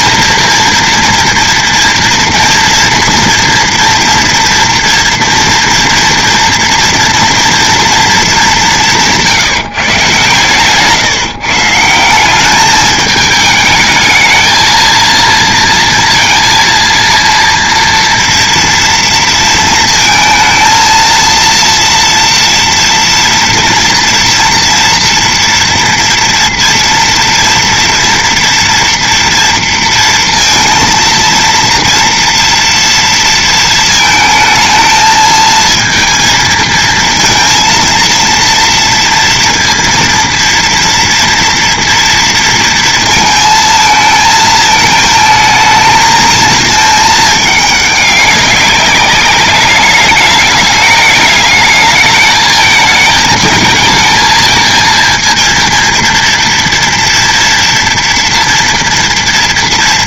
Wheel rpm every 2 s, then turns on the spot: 230, 230, 230, 230, 200, 140, 200, 220, 230, 230, 230, 230, 230, 230, 230, 230, 230, 220, 230, 230, 230, 230, 220, 220, 200, 210, 220, 220, 230, 230.
none